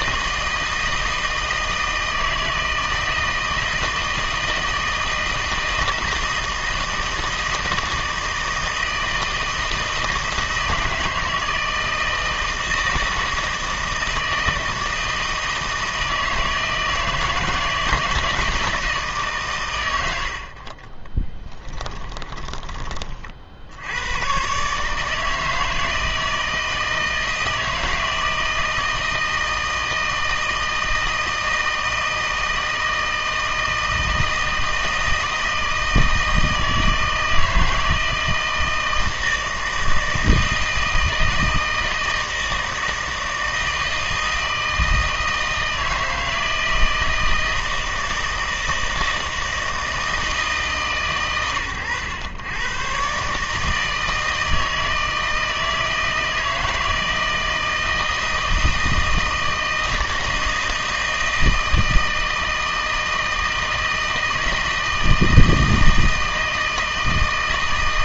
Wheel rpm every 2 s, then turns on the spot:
160, 160, 160, 160, 160, 160, 160, 160, 160, 160, 40, 20, 140, 160, 160, 160, 160, 160, 160, 160, 160, 160, 160, 160, 160, 150, 110, 160, 160, 160, 160, 160, 160, 160.
none